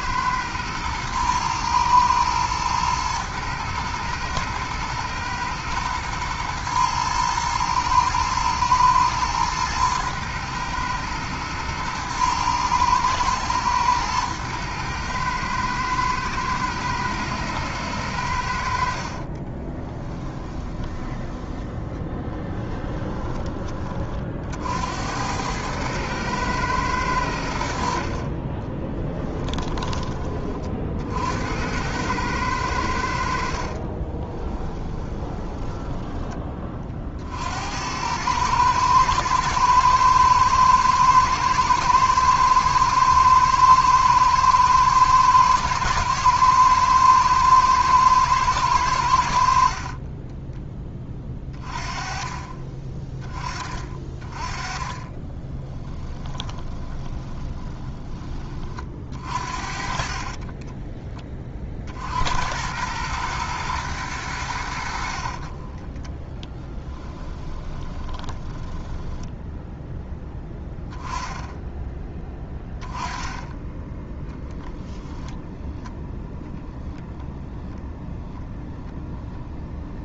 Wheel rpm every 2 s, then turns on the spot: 110, 110, 120, 120, 110, 110, 110, 110, 110, 60, 10, 10, 70, 100, 10, 50, 90, 10, 40, 110, 110, 110, 120, 110, 100, 20, 30, 20, 20, 40, 30, 100, 70, 20, 10, 10, 10, 0, 0, 0.
18-24 28-30 34-36 54-58 60-62 66-70